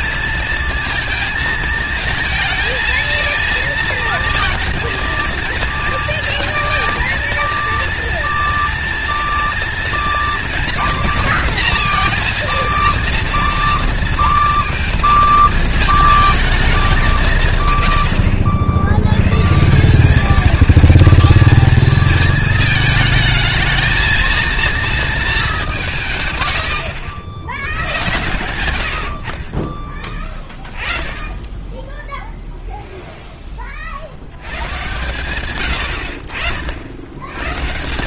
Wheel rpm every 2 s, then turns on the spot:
230, 230, 230, 220, 230, 230, 230, 230, 210, 70, 220, 220, 230, 110, 90, 20, 0, 100, 70.
none